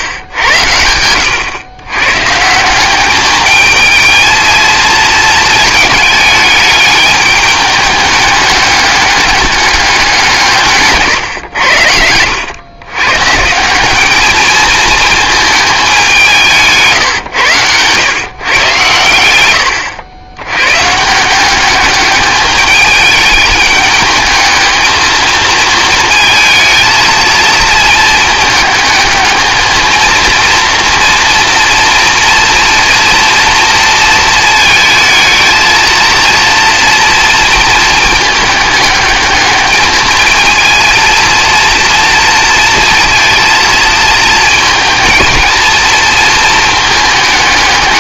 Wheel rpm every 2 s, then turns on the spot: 90, 180, 220, 210, 200, 150, 110, 220, 160, 120, 120, 210, 220, 230, 220, 230, 230, 220, 230, 220, 230, 230, 220, 220.
none